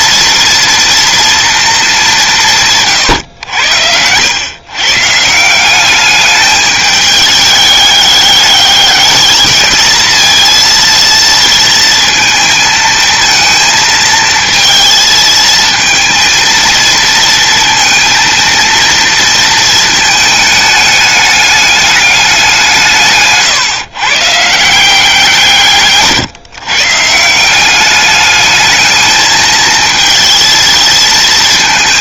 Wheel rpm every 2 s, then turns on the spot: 230, 150, 130, 210, 210, 230, 230, 230, 230, 230, 210, 170, 160, 140, 220, 230.
none